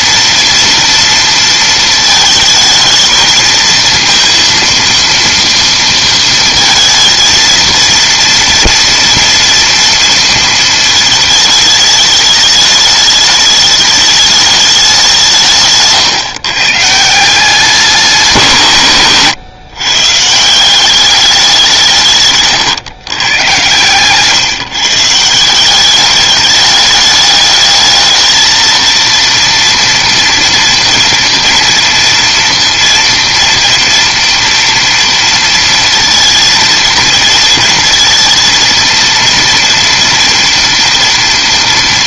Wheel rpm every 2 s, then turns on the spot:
230, 220, 230, 230, 230, 220, 210, 210, 130, 170, 170, 120, 140, 210, 220, 230, 230, 230, 230, 230, 230.
none